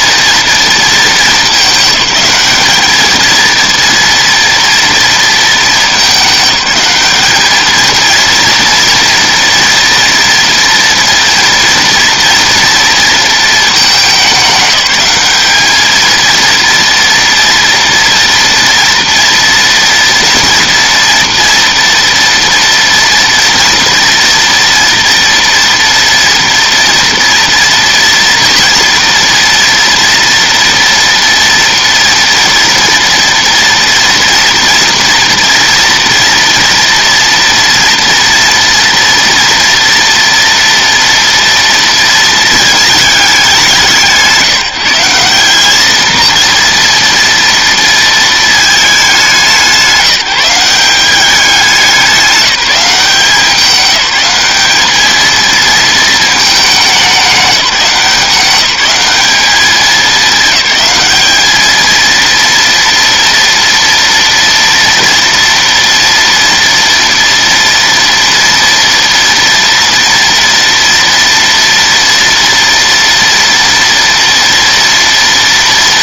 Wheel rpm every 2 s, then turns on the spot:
220, 220, 230, 210, 230, 230, 230, 200, 230, 230, 230, 230, 230, 230, 230, 230, 230, 230, 230, 230, 230, 210, 170, 230, 200, 190, 180, 210, 210, 200, 210, 230, 230, 230, 230, 230, 230, 230.
none